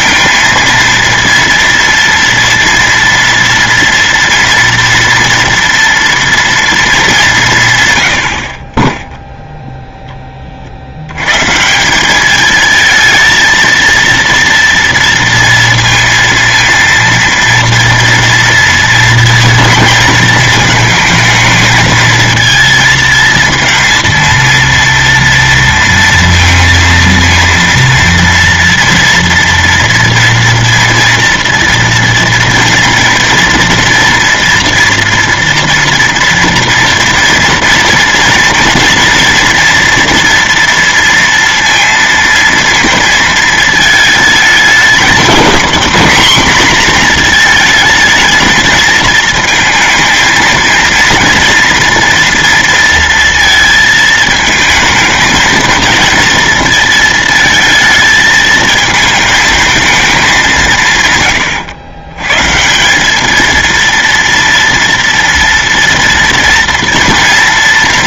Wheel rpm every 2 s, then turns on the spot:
230, 230, 230, 230, 30, 40, 220, 230, 230, 230, 220, 230, 230, 230, 230, 230, 230, 230, 230, 230, 230, 230, 220, 230, 220, 220, 230, 220, 230, 220, 170, 160, 230, 230.
none